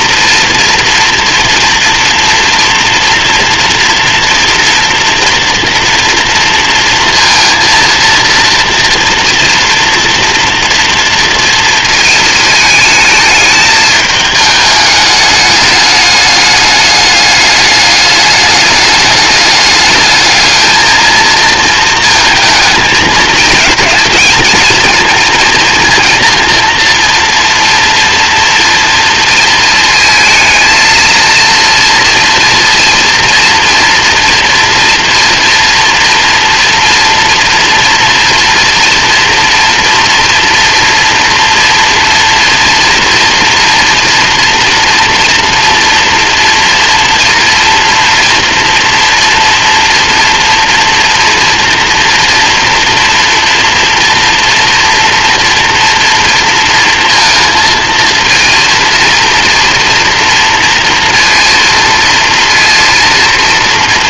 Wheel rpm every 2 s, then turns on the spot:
240, 230, 230, 230, 230, 230, 220, 210, 210, 210, 220, 220, 230, 230, 230, 230, 230, 230, 230, 230, 230, 230, 230, 230, 230, 240, 230, 230, 230, 230, 230, 230.
none